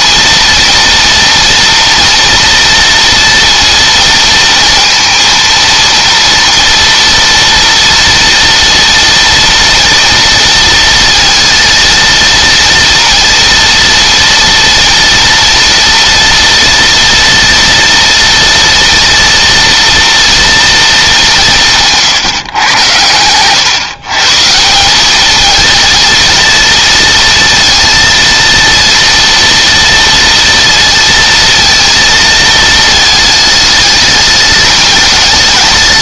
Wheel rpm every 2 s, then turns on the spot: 230, 230, 230, 230, 230, 230, 230, 230, 230, 230, 220, 110, 190, 230, 230, 230, 220, 210.
none